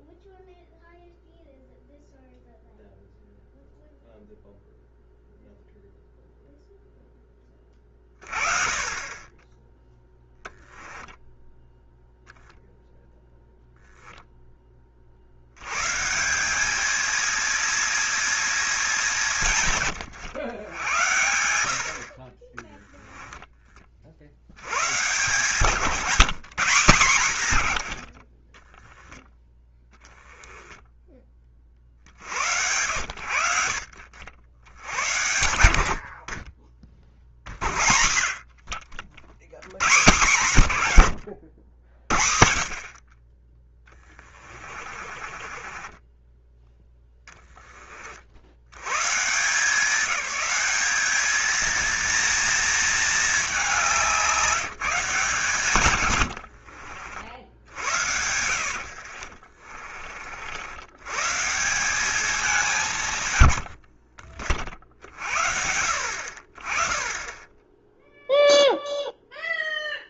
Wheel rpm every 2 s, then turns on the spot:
0, 0, 0, 0, 40, 0, 0, 10, 190, 220, 100, 20, 100, 170, 20, 20, 80, 70, 30, 40, 120, 50, 30, 10, 80, 200, 230, 170, 80, 60, 70, 190, 50, 30, 0.
22-24 44-46 56-60